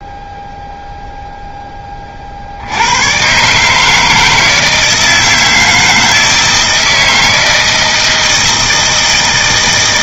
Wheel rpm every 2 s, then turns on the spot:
0, 100, 160, 160, 170.
none